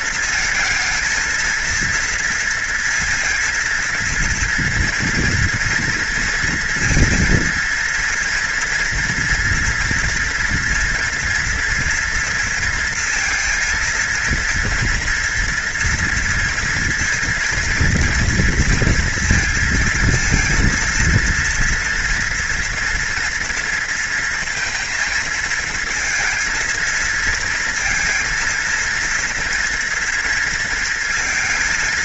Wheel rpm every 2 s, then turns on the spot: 220, 230, 230, 230, 230, 240, 230, 230, 230, 230, 230, 240, 230, 220, 230, 230.
none